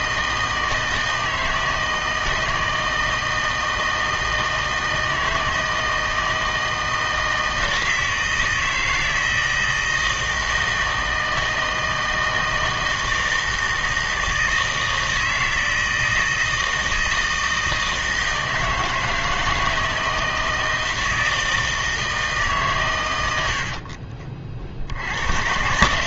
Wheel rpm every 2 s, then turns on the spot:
160, 160, 160, 160, 160, 160, 160, 160, 160, 160, 160, 150, 50.
none